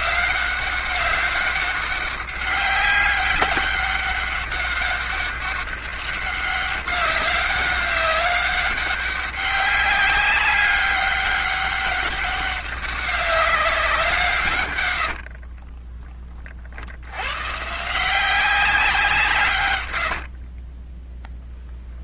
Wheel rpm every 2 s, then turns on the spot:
200, 200, 200, 200, 200, 200, 200, 60, 120, 150, 0.
14-16